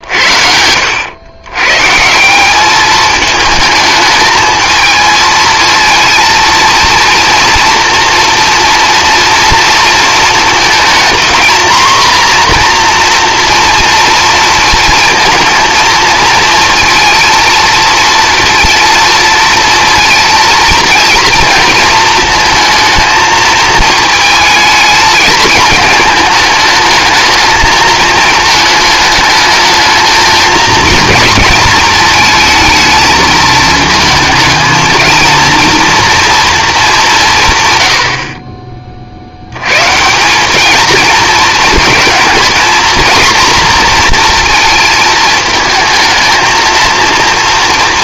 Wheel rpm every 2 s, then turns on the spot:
90, 210, 220, 230, 230, 230, 240, 230, 230, 230, 230, 220, 220, 220, 220, 230, 220, 230, 200, 40, 220, 230, 230, 230.
none